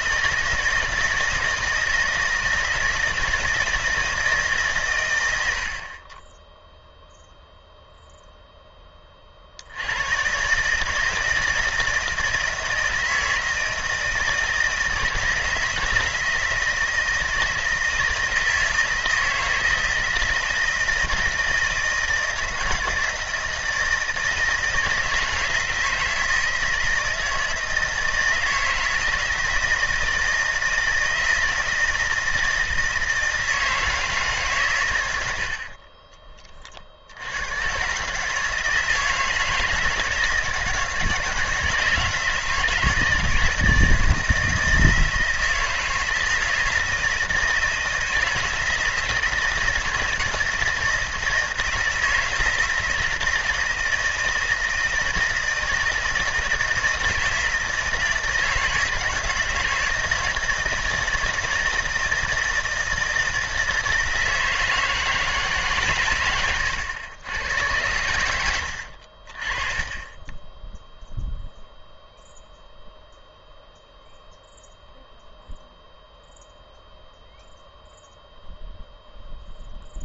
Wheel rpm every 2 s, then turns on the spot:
160, 160, 120, 0, 20, 160, 160, 160, 160, 160, 160, 160, 160, 160, 160, 170, 160, 110, 70, 160, 160, 160, 160, 160, 160, 160, 160, 160, 160, 160, 160, 160, 160, 100, 60, 0, 0, 0, 0, 0.
none